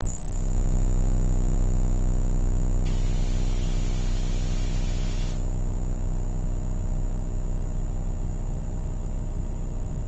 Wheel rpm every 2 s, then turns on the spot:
0, 0, 0, 0, 0.
none